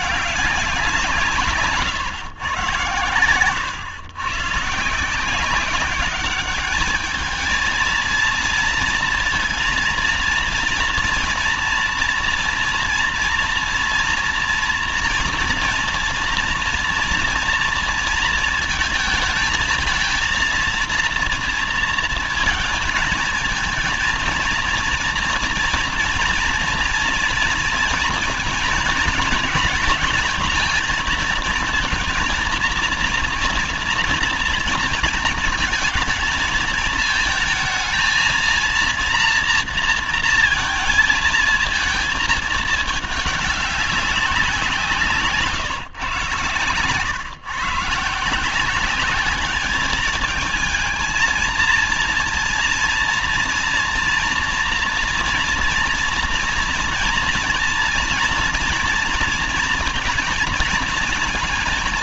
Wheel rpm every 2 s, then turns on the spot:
200, 120, 130, 200, 230, 230, 230, 230, 230, 220, 230, 220, 230, 230, 230, 230, 240, 240, 220, 230, 230, 220, 180, 130, 160, 210, 230, 230, 230, 230, 220.
none